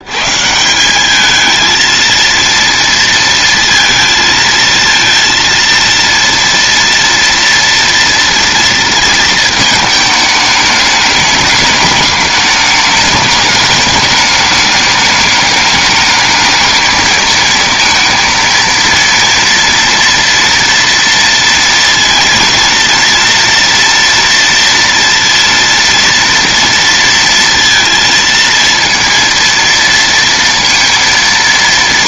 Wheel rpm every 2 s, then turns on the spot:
170, 230, 230, 230, 230, 210, 210, 210, 220, 230, 230, 230, 230, 230, 230, 230.
none